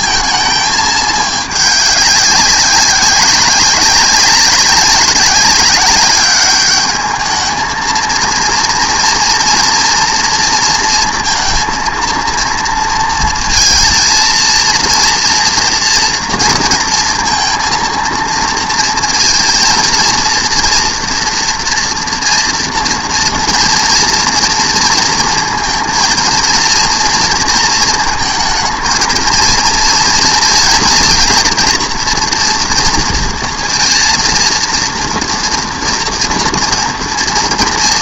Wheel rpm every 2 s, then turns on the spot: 220, 200, 200, 200, 230, 230, 230, 230, 230, 230, 230, 230, 230, 230, 220, 230, 230, 230, 230.
none